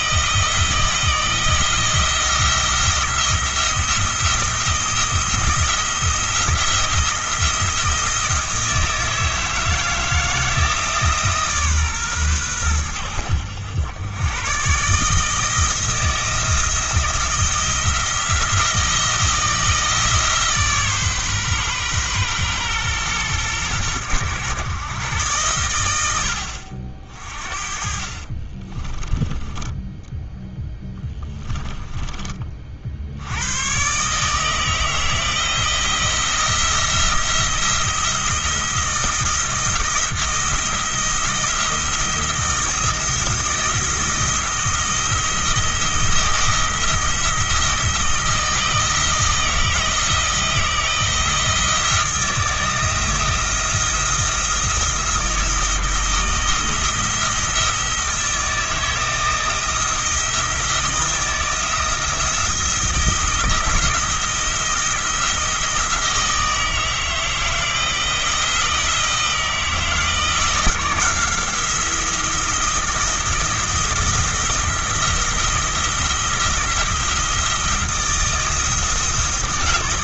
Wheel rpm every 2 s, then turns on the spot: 160, 170, 170, 170, 160, 160, 90, 130, 170, 160, 150, 120, 120, 60, 30, 10, 40, 160, 170, 170, 170, 170, 170, 170, 160, 170, 170, 170, 160, 160, 170, 170, 170, 160, 160, 170, 170, 170, 170, 160.
28-32